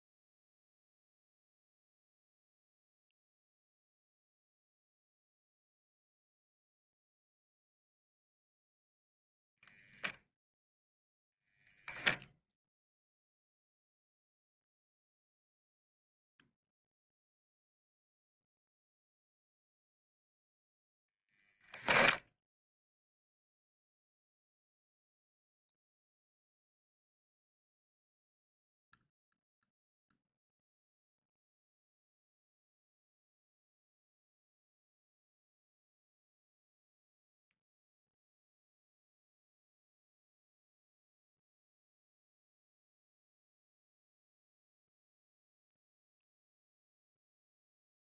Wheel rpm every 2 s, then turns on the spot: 0, 0, 0, 0, 0, 0, 0, 0, 0, 0, 0, 0, 0, 0, 0, 0, 0, 0, 0, 0, 0, 0, 0, 0.
none